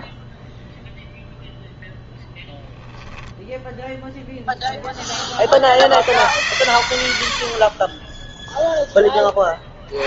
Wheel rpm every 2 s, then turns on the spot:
0, 0, 0, 90, 10.
6-10